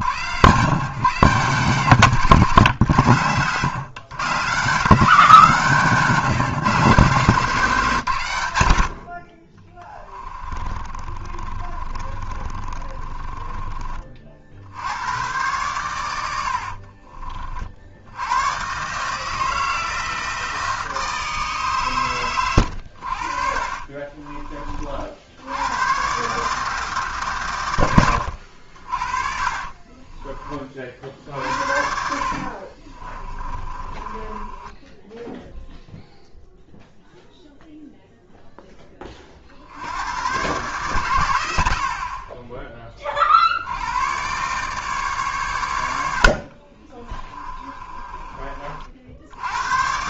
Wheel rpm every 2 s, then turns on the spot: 130, 140, 150, 150, 100, 20, 30, 80, 60, 120, 160, 90, 40, 160, 80, 40, 50, 10, 0, 10, 130, 30, 140, 40, 50.
10-14 16-18 22-24 32-36 46-48